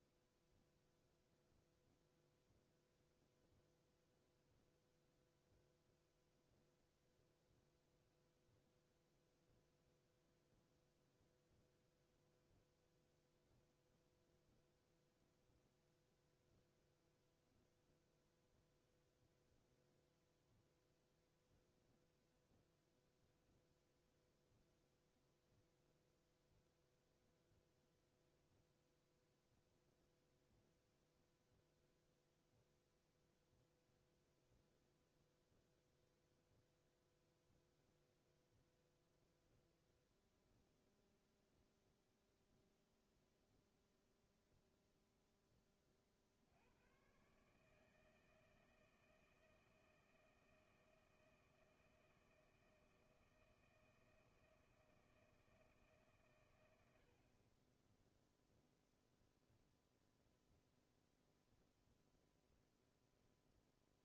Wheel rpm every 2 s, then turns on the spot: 0, 0, 0, 0, 0, 0, 0, 0, 0, 0, 0, 0, 0, 0, 0, 0, 0, 0, 0, 0, 0, 0, 0, 70, 160, 160, 160, 170, 120, 0, 0, 0.
none